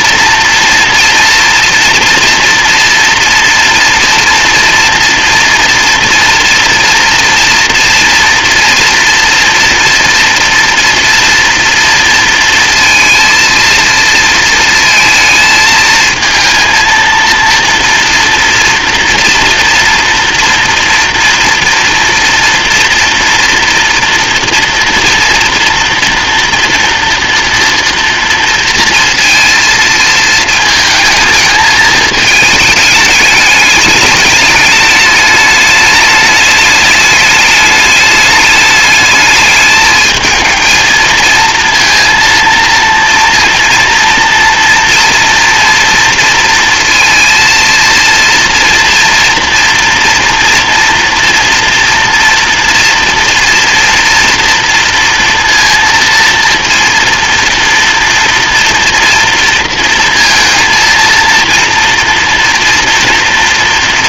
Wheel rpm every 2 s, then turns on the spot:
230, 230, 240, 240, 230, 230, 230, 230, 230, 230, 230, 240, 230, 240, 230, 220, 220, 210, 210, 210, 220, 230, 230, 230, 240, 230, 230, 230, 230, 230, 230, 230.
none